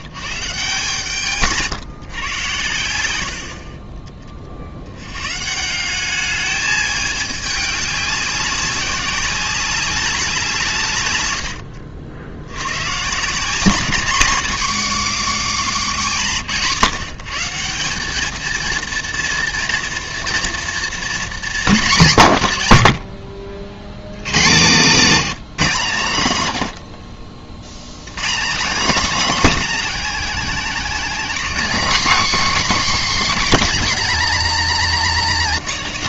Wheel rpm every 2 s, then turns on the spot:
140, 110, 60, 210, 190, 160, 90, 230, 170, 220, 230, 150, 120, 130, 220, 260, 280, 230.
none